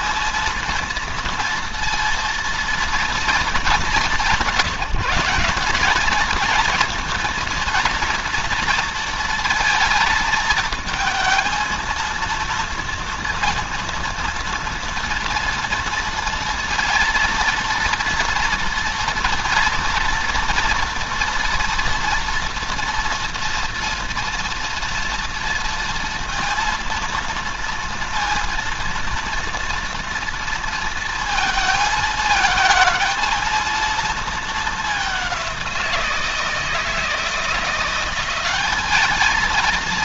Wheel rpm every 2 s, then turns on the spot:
230, 230, 160, 230, 230, 230, 230, 230, 230, 230, 230, 240, 230, 230, 230, 230, 230, 210, 160, 210.
none